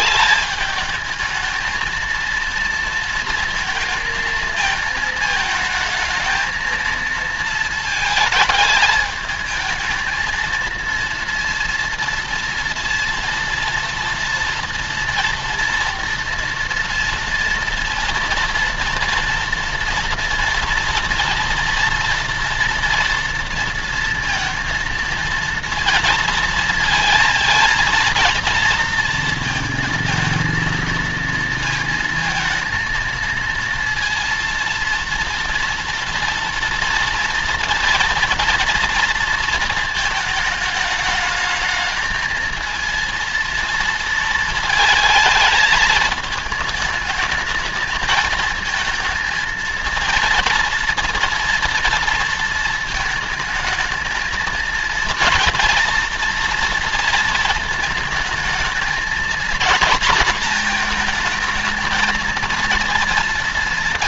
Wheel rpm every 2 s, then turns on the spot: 210, 230, 220, 220, 220, 230, 230, 230, 230, 230, 230, 230, 230, 220, 230, 230, 230, 230, 230, 230, 220, 230, 230, 210, 220, 230, 230, 230, 230, 220, 240, 230.
none